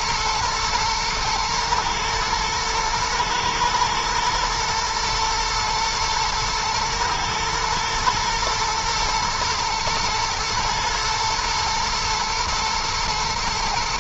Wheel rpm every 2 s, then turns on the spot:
110, 110, 110, 120, 120, 120, 110.
none